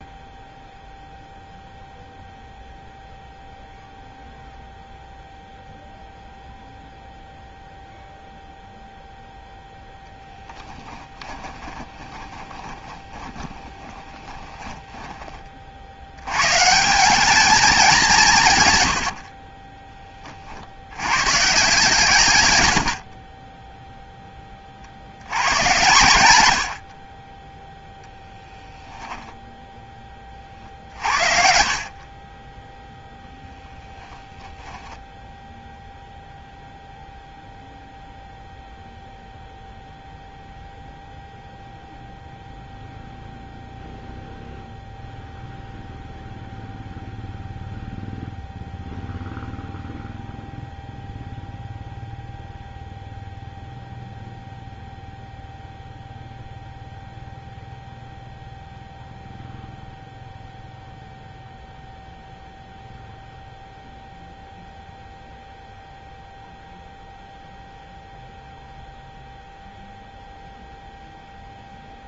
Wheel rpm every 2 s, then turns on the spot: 0, 0, 0, 0, 0, 10, 20, 10, 110, 160, 30, 120, 20, 90, 10, 40, 20, 0, 0, 0, 0, 0, 0, 0, 0, 0, 0, 0, 0, 0, 0, 0, 0, 0, 0, 0.
10-16 28-30